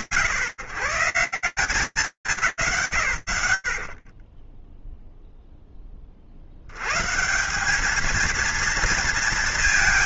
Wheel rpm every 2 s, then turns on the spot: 150, 90, 0, 130, 230.
none